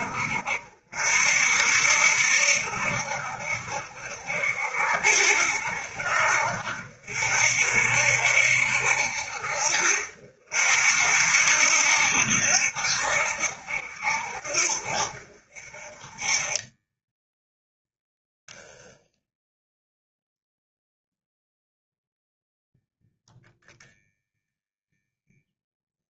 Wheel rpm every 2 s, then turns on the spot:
60, 70, 70, 70, 70, 60, 70, 60, 20, 10, 0, 0, 0.
16-20